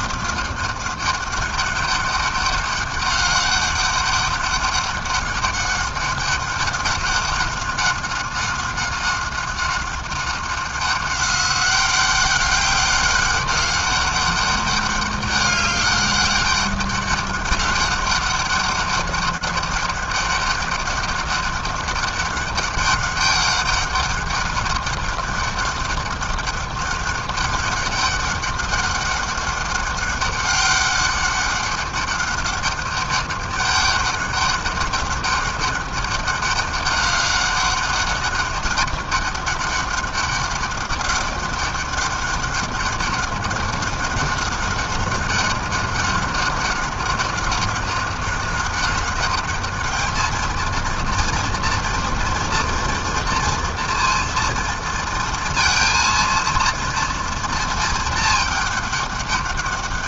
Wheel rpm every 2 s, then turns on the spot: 180, 200, 200, 190, 190, 190, 190, 200, 200, 200, 200, 200, 200, 200, 200, 200, 200, 200, 200, 200, 200, 200, 190, 190, 190, 230, 230, 230, 230, 210.
none